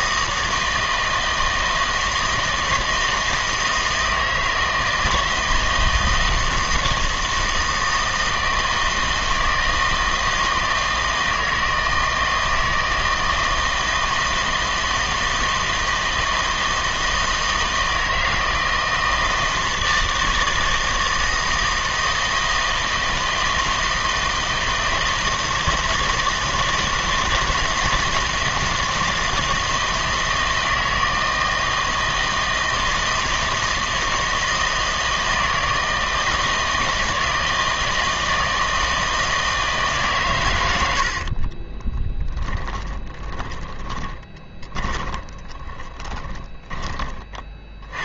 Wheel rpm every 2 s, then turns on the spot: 160, 160, 160, 160, 160, 160, 160, 160, 160, 160, 160, 160, 160, 160, 160, 160, 160, 160, 160, 160, 90, 20, 20, 20.
42-46